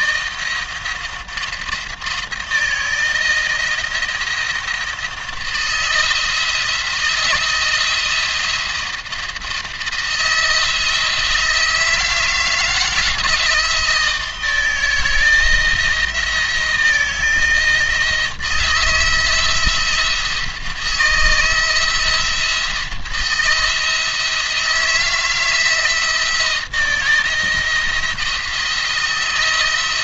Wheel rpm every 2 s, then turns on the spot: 170, 170, 160, 170, 170, 170, 160, 160, 170, 170, 160, 170, 160, 160, 170.
none